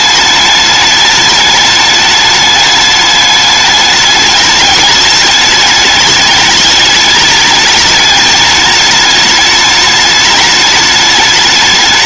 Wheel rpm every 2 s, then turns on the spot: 210, 210, 210, 210, 210, 210.
none